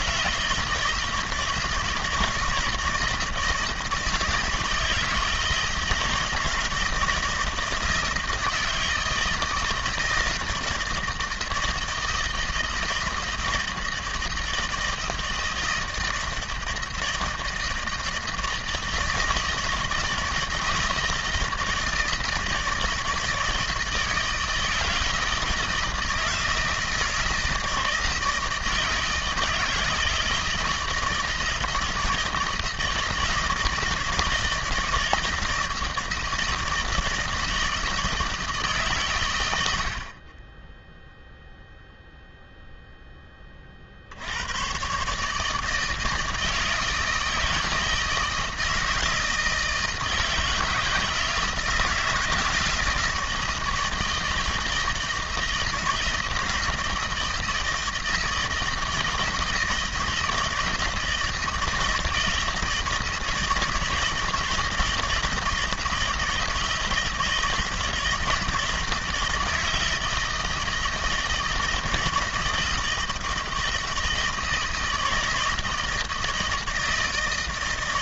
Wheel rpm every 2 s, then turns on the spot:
160, 160, 160, 160, 160, 160, 160, 160, 160, 160, 160, 160, 160, 160, 160, 160, 160, 160, 160, 150, 10, 0, 120, 160, 160, 160, 170, 160, 160, 160, 160, 160, 160, 160, 160, 160, 160, 160, 160.
none